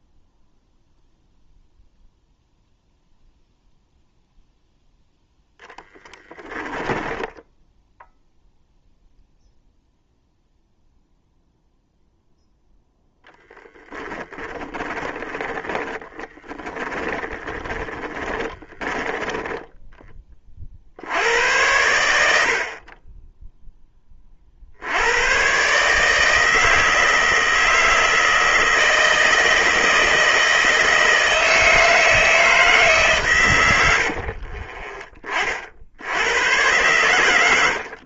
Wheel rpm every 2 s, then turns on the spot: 0, 0, 0, 10, 0, 0, 0, 20, 20, 20, 40, 50, 60, 160, 160, 160, 160, 40, 100.
6-8 14-20 34-36